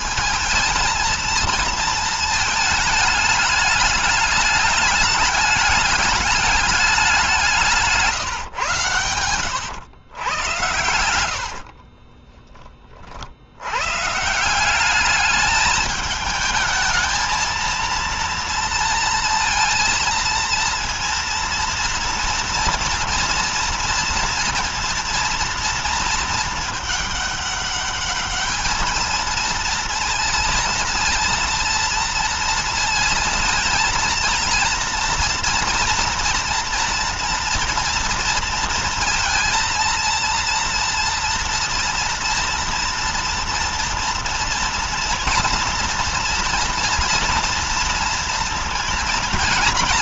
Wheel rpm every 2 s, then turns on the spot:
220, 220, 210, 200, 130, 100, 30, 160, 220, 230, 230, 230, 230, 230, 210, 230, 230, 230, 230, 230, 230, 230, 230, 230, 230.
none